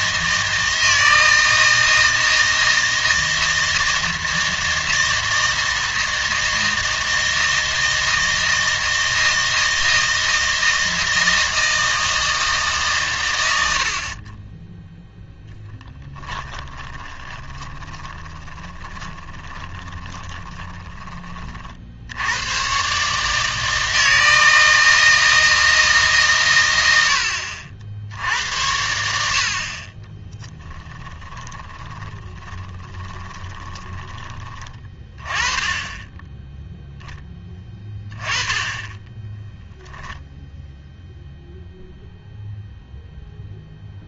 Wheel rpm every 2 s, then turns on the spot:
160, 160, 160, 160, 160, 160, 150, 10, 20, 20, 20, 120, 160, 110, 90, 10, 20, 20, 0, 20, 0, 0.
16-22 30-34